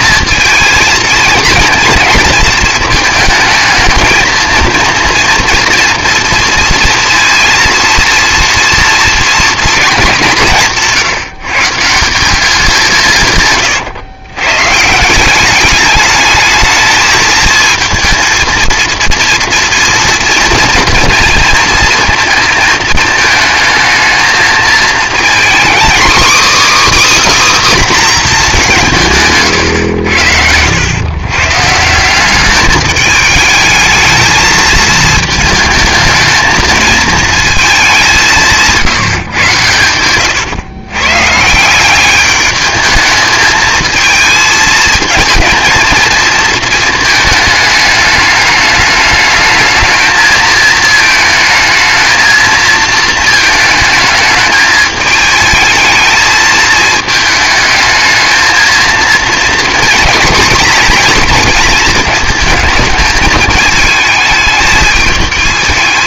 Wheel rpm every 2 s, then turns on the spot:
230, 220, 230, 230, 230, 160, 180, 140, 220, 230, 230, 220, 230, 310, 170, 100, 210, 220, 220, 160, 130, 210, 220, 220, 210, 220, 230, 220, 220, 230, 230, 220, 220.
none